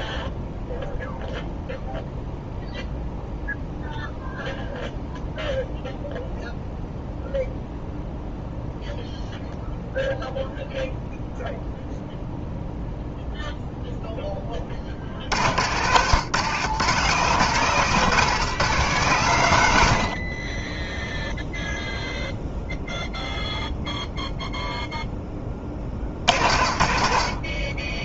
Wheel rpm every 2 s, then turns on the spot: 0, 0, 0, 0, 0, 0, 0, 30, 140, 160, 20, 0, 0, 60.
none